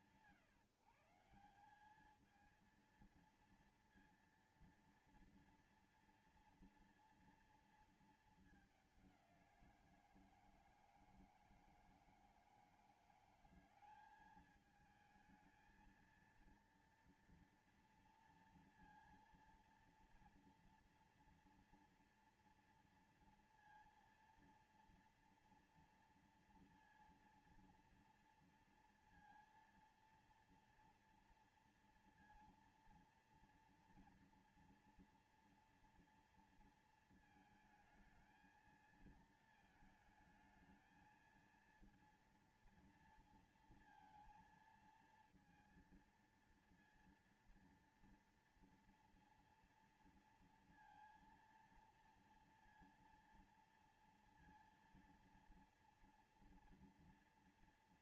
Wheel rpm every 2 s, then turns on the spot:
160, 190, 230, 230, 220, 180, 160, 190, 220, 230, 230, 230, 230, 230, 230, 230, 230, 230, 230, 220, 220, 230, 230, 230, 230, 230, 230, 230, 230.
none